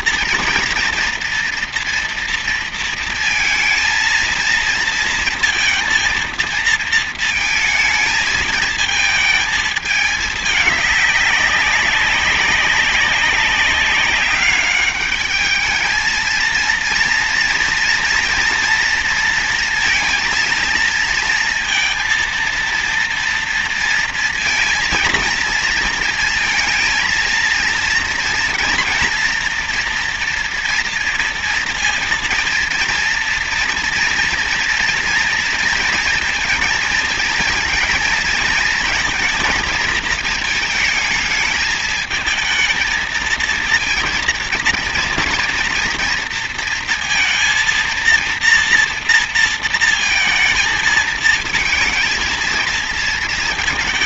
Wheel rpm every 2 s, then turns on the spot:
230, 230, 230, 230, 220, 210, 200, 200, 230, 230, 230, 230, 230, 230, 230, 230, 230, 230, 230, 230, 220, 220, 230, 230, 230, 230, 230.
none